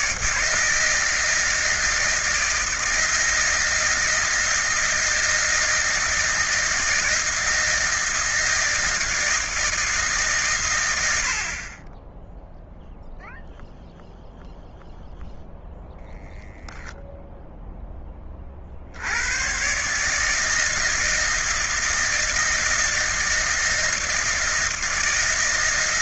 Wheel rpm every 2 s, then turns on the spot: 160, 160, 160, 160, 160, 120, 0, 0, 0, 50, 160, 160, 160.
none